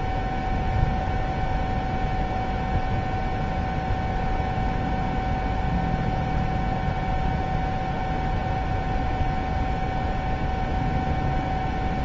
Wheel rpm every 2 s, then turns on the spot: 0, 0, 0, 0, 0, 0.
none